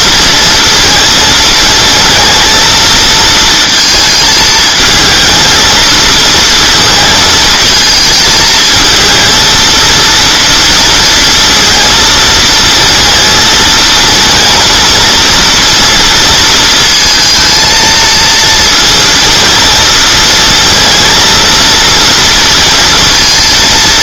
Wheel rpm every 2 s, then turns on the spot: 230, 230, 220, 230, 220, 230, 230, 230, 230, 230, 230, 230.
none